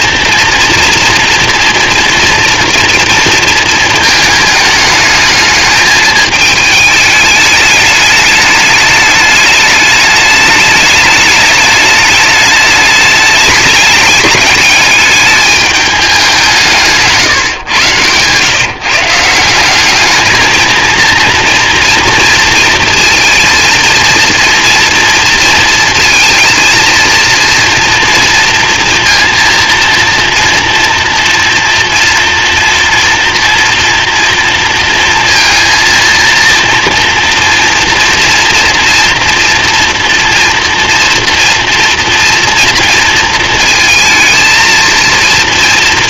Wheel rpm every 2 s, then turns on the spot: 230, 230, 210, 220, 210, 210, 210, 210, 170, 150, 220, 230, 230, 230, 230, 230, 230, 230, 230, 240, 240, 230, 220.
none